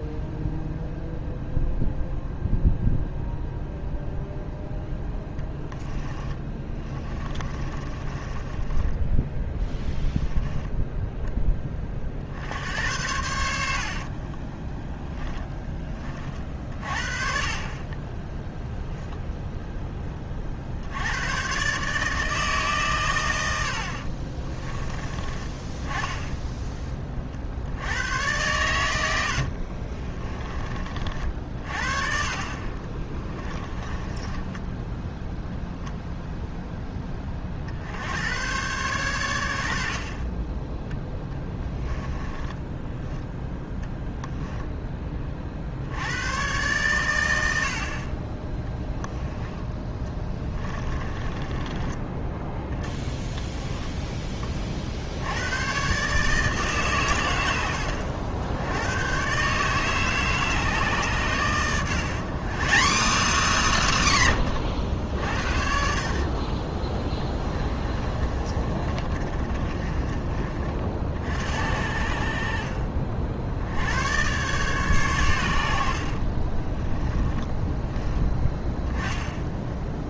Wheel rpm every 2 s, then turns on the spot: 0, 0, 10, 20, 20, 10, 80, 10, 40, 0, 50, 120, 20, 20, 90, 40, 30, 10, 10, 120, 10, 10, 10, 110, 10, 20, 10, 50, 140, 110, 140, 220, 90, 20, 30, 50, 50, 130, 20, 10.
6-12 14-16 28-30 32-36 42-44 50-52 68-70 76-78